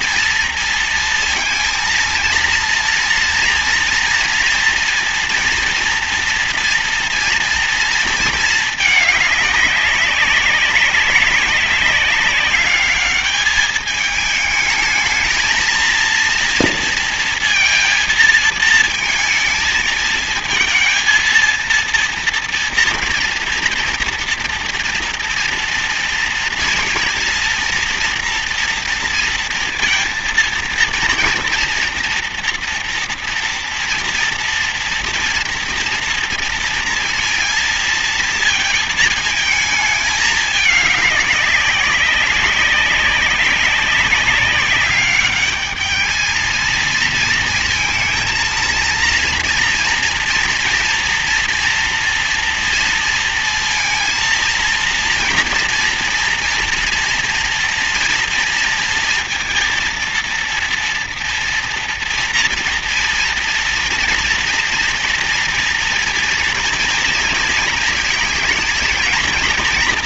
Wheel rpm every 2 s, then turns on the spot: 230, 230, 240, 230, 210, 200, 200, 220, 230, 220, 220, 240, 230, 230, 230, 230, 230, 240, 230, 220, 210, 190, 200, 220, 230, 230, 230, 230, 230, 230, 230, 230, 230, 230, 230.
none